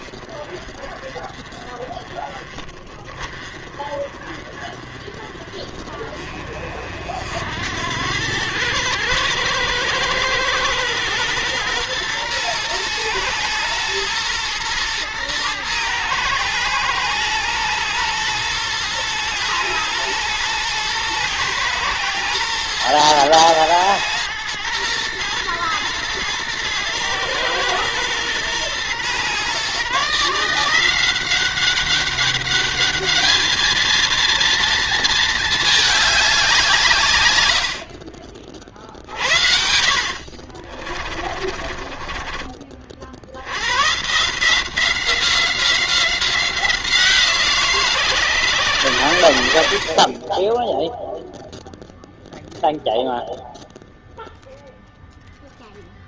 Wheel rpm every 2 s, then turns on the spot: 30, 30, 30, 40, 100, 110, 120, 120, 110, 110, 110, 120, 110, 110, 120, 160, 210, 230, 180, 40, 40, 40, 160, 180, 130, 20, 0, 0.
40-42